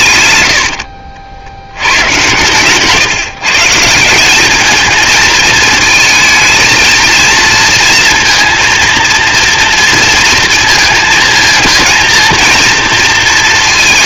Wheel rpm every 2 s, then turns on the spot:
70, 140, 220, 230, 230, 220, 230.
0-2